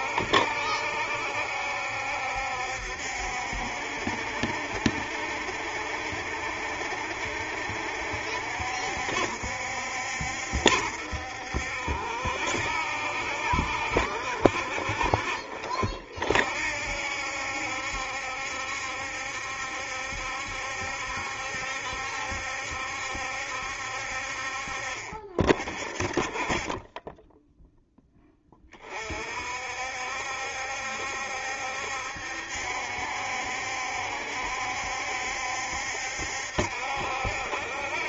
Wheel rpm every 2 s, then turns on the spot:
70, 70, 70, 70, 70, 70, 70, 50, 70, 70, 70, 70, 50, 20, 30, 70, 70, 70, 70.
none